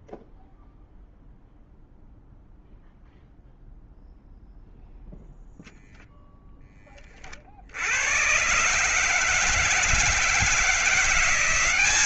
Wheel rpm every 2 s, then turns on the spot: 0, 0, 0, 20, 130, 170.
none